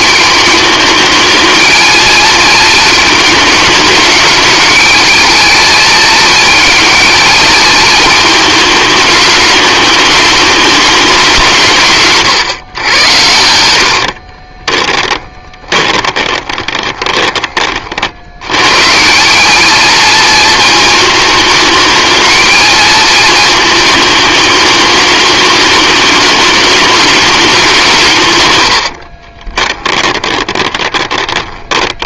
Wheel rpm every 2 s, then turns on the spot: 210, 220, 210, 220, 210, 200, 110, 10, 20, 140, 230, 220, 210, 210, 90, 20.
14-18 28-32